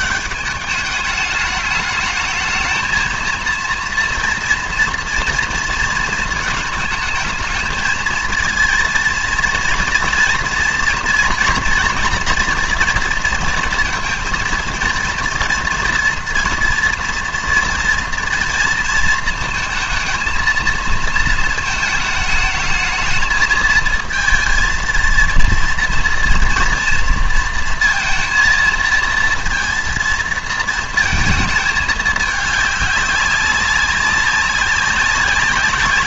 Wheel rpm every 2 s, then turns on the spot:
210, 220, 230, 220, 230, 230, 230, 230, 230, 230, 230, 210, 230, 230, 230, 230, 210, 200.
none